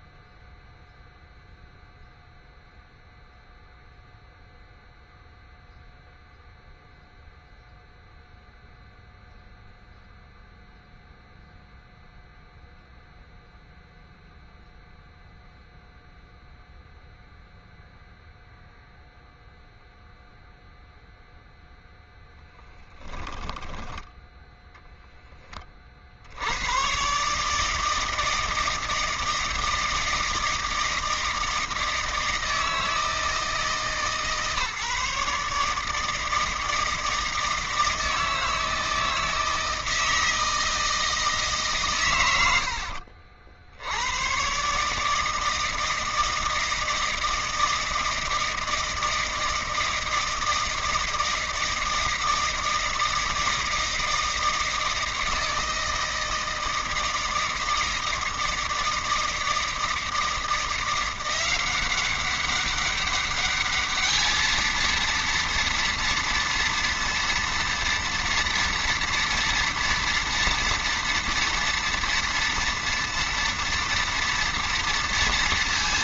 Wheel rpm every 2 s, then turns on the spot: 0, 0, 0, 0, 0, 0, 0, 0, 0, 0, 0, 10, 10, 90, 160, 160, 160, 150, 160, 160, 160, 100, 130, 160, 160, 160, 160, 160, 160, 160, 170, 200, 220, 230, 230, 230, 230, 230.
22-26 42-44